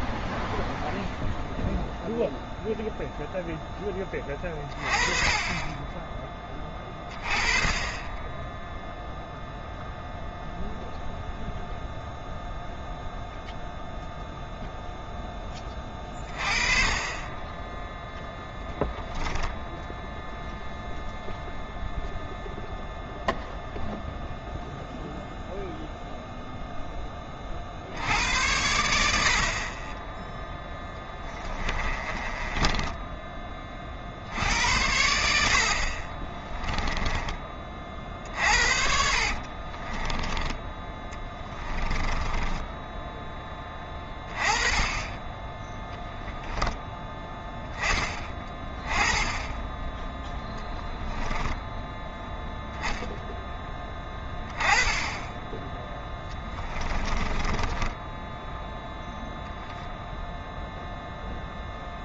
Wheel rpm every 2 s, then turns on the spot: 0, 0, 20, 20, 0, 0, 0, 0, 20, 10, 0, 0, 0, 0, 80, 10, 20, 70, 20, 50, 20, 10, 20, 10, 20, 10, 0, 10, 20, 0, 0.
32-34 36-40 42-44 50-52 56-58